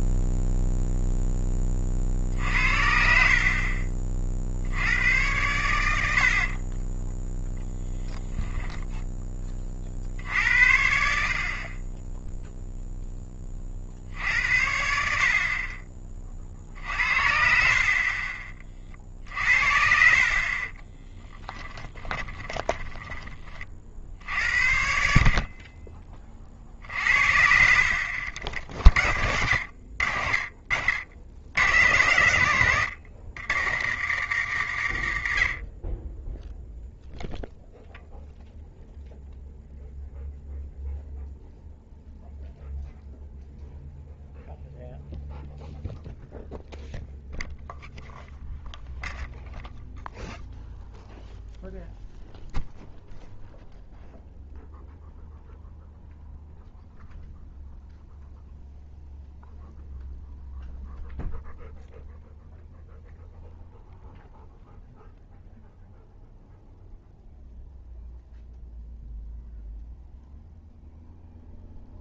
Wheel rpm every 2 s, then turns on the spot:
0, 50, 70, 30, 10, 60, 0, 70, 50, 40, 20, 10, 70, 50, 40, 60, 110, 100, 0, 0, 0, 0, 0, 0, 0, 0, 0, 0, 0, 0, 0, 0, 0, 0, 0, 0.
6-8 20-24